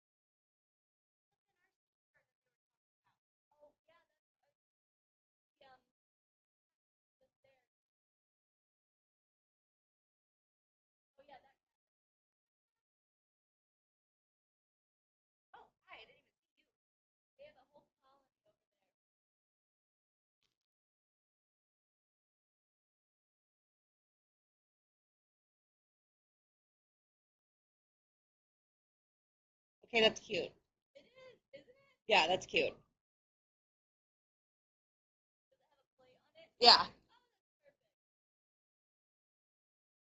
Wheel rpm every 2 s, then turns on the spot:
0, 0, 0, 0, 0, 0, 0, 0, 0, 0, 0, 0, 0, 0, 0, 0, 0, 0, 0, 0.
none